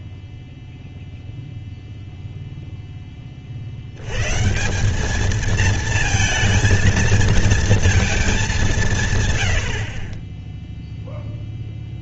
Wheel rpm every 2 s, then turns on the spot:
0, 20, 200, 230, 170, 0.
none